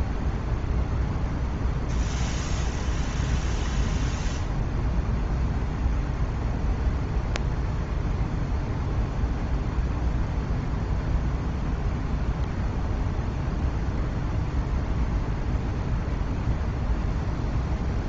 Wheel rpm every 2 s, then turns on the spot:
0, 0, 0, 0, 0, 0, 0, 0, 0.
none